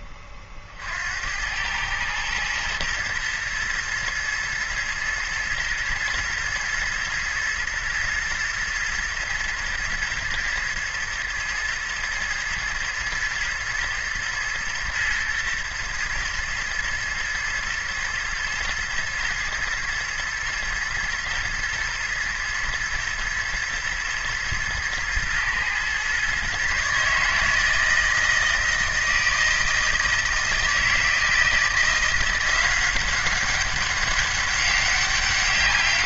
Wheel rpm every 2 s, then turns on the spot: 40, 110, 120, 110, 110, 110, 110, 120, 120, 110, 120, 120, 110, 140, 160, 160, 180, 190.
none